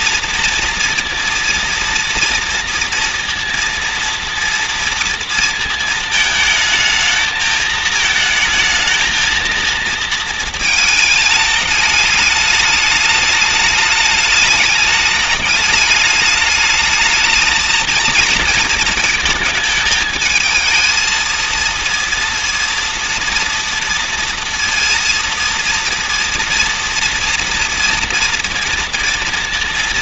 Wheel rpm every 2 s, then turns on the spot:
230, 230, 230, 220, 220, 220, 210, 210, 210, 230, 220, 230, 230, 230, 230.
none